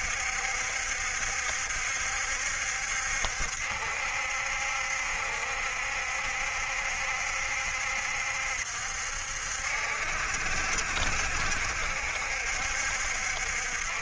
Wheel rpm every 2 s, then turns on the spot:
60, 70, 70, 70, 70, 70, 60.
none